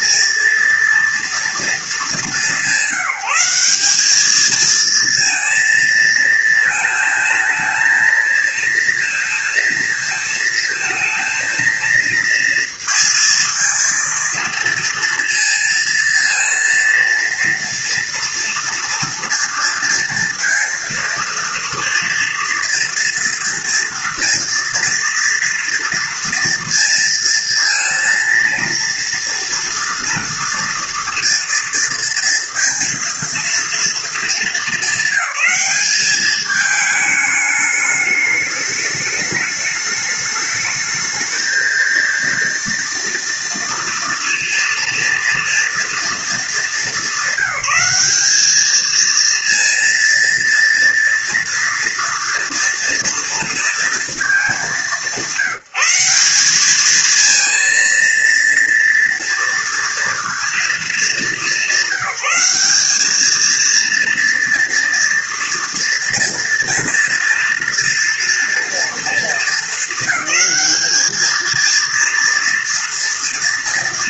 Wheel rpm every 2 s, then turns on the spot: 230, 190, 230, 220, 230, 220, 230, 230, 230, 230, 230, 230, 230, 230, 230, 240, 230, 200, 210, 210, 220, 230, 230, 200, 230, 230, 230, 190, 220, 230, 210, 210, 230, 240, 230, 220, 230.
none